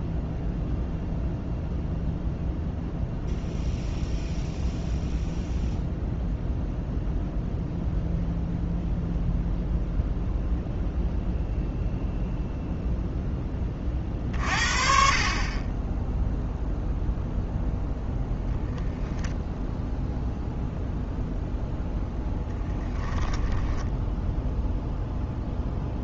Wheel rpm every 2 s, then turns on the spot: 0, 0, 0, 0, 0, 0, 0, 40, 0, 0, 0, 10, 0.
none